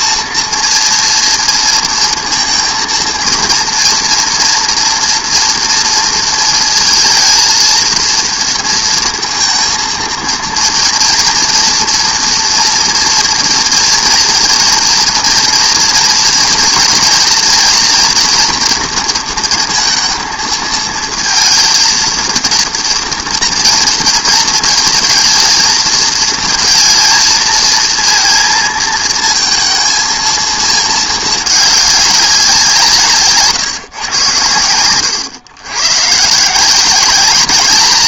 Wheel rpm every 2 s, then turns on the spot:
240, 230, 230, 230, 230, 230, 230, 240, 230, 230, 220, 230, 230, 230, 230, 220, 170, 100, 170.
none